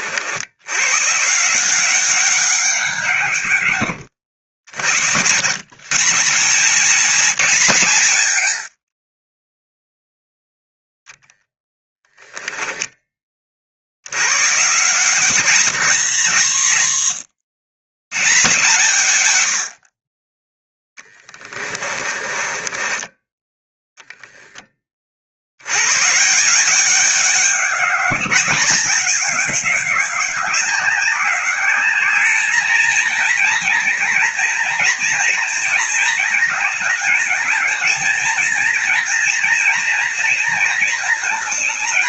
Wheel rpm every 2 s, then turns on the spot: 130, 170, 90, 210, 40, 0, 20, 150, 130, 130, 10, 20, 40, 200, 200, 190, 220, 230, 210, 230, 230.
20-24